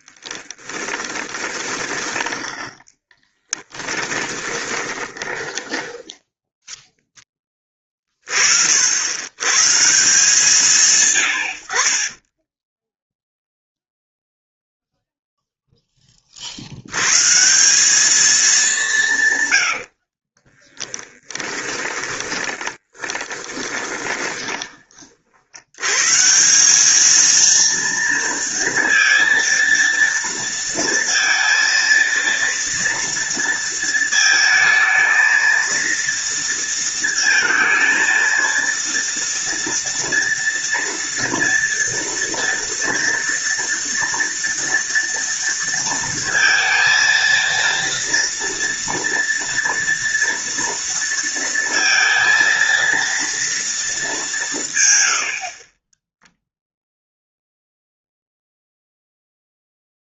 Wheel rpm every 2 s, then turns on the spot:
10, 10, 20, 0, 80, 160, 10, 0, 100, 190, 10, 10, 30, 210, 230, 230, 230, 220, 230, 230, 230, 230, 230, 230, 230, 230, 230, 120, 0, 0.
0-2 4-6 12-14 20-24